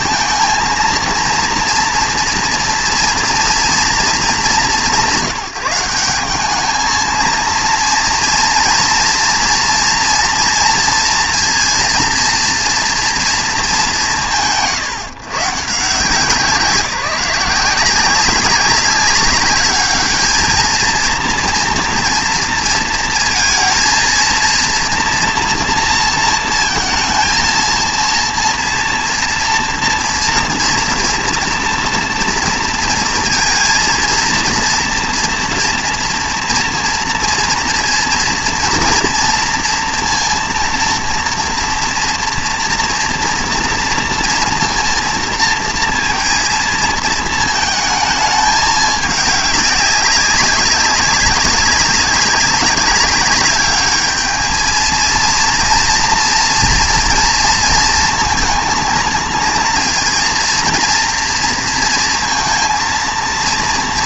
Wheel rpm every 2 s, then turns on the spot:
230, 230, 180, 210, 230, 230, 230, 120, 170, 200, 220, 230, 230, 230, 230, 230, 230, 230, 240, 230, 230, 230, 230, 230, 210, 200, 190, 220, 230, 230, 230, 230.
none